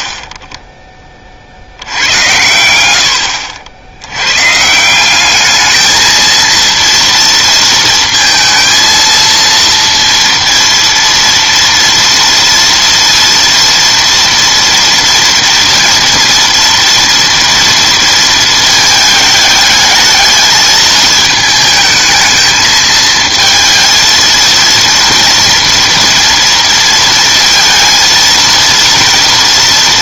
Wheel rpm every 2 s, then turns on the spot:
10, 100, 130, 230, 230, 230, 230, 230, 230, 220, 220, 220, 230, 230, 230.
none